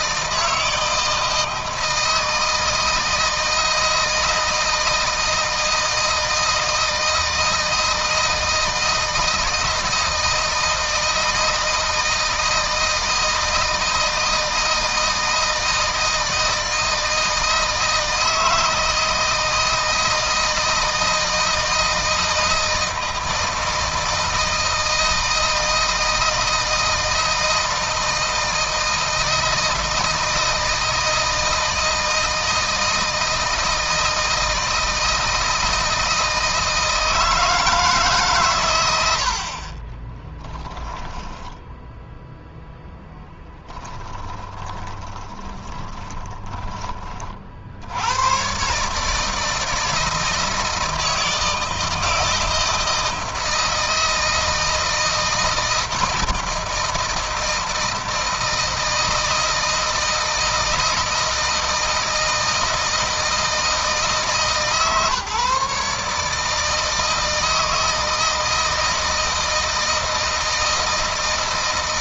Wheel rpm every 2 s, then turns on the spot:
160, 160, 160, 160, 160, 160, 160, 160, 160, 160, 160, 160, 160, 160, 160, 160, 160, 160, 160, 100, 10, 0, 20, 20, 140, 160, 160, 160, 160, 160, 160, 160, 150, 160, 160, 160.
40-42 44-46